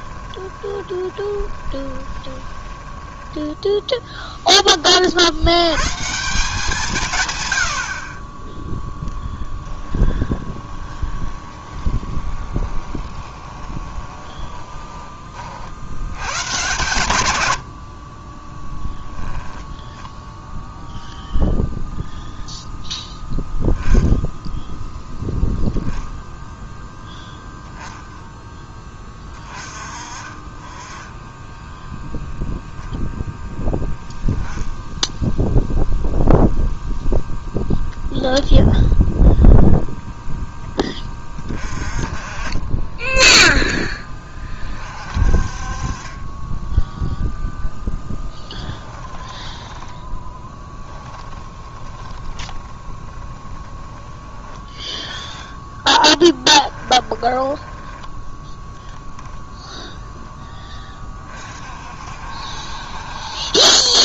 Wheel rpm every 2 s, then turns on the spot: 20, 10, 30, 160, 0, 20, 20, 20, 140, 0, 0, 0, 0, 0, 10, 10, 0, 0, 0, 0, 0, 20, 30, 10, 10, 10, 20, 20, 10, 10, 20, 70.
0-4 10-16 48-54 56-58